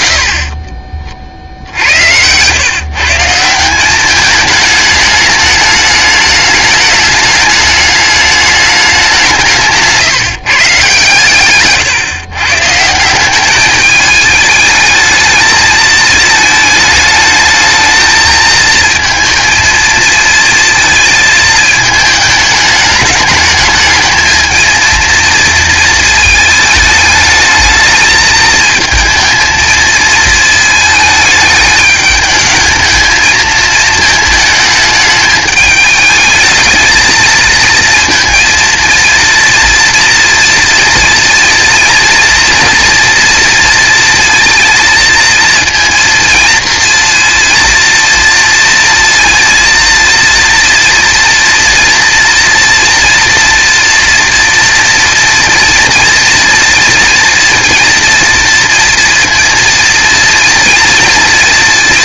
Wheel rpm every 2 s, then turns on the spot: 30, 120, 210, 210, 210, 150, 140, 220, 220, 220, 220, 210, 230, 220, 220, 220, 210, 220, 220, 230, 230, 230, 230, 230, 230, 230, 230, 230, 230, 230, 230.
0-2